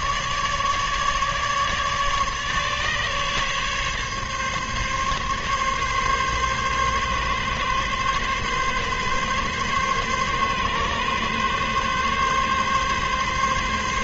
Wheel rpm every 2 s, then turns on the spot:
150, 140, 140, 140, 140, 140, 140.
none